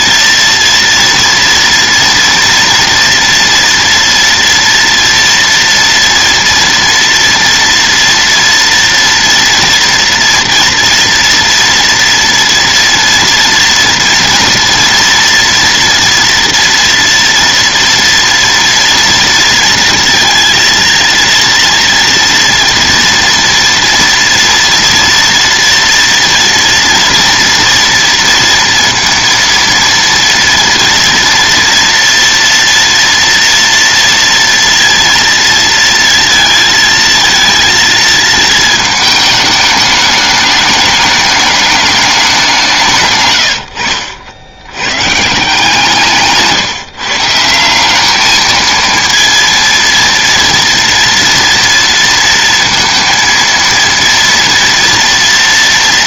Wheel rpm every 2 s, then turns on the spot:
230, 230, 230, 230, 230, 230, 230, 230, 230, 230, 230, 230, 230, 230, 230, 230, 230, 230, 230, 220, 210, 180, 90, 150, 220, 230, 230, 230.
none